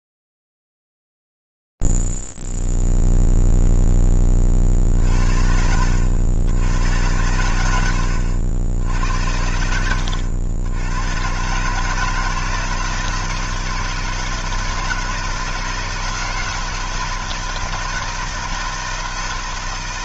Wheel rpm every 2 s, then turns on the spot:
0, 0, 0, 70, 80, 80, 160, 160, 160, 160.
8-10